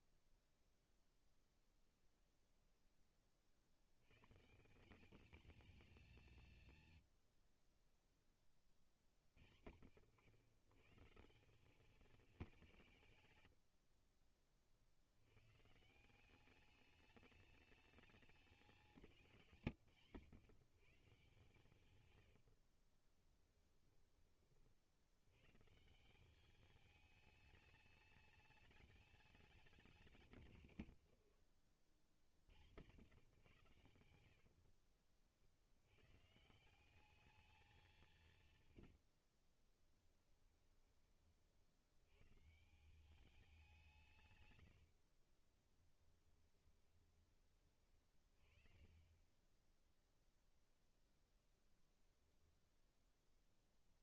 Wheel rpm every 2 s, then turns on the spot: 0, 10, 170, 90, 50, 140, 130, 80, 210, 180, 140, 30, 80, 210, 210, 120, 100, 50, 200, 60, 30, 180, 50, 20, 20, 0, 10.
22-24 30-32 38-40 44-46